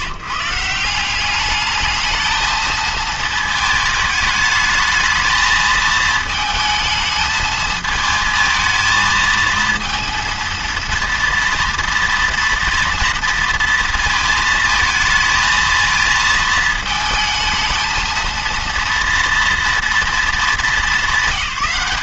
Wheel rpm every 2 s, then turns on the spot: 150, 220, 210, 220, 220, 230, 230, 220, 220, 230, 200.
none